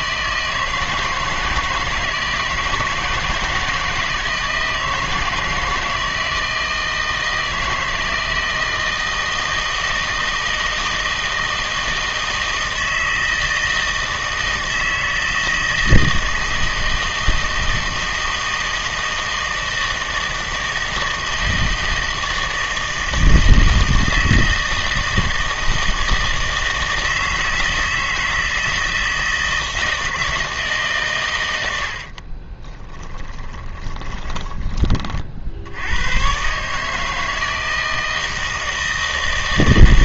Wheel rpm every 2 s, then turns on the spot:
160, 160, 160, 160, 160, 160, 160, 160, 160, 160, 160, 160, 160, 160, 160, 150, 20, 20, 150, 160.
32-34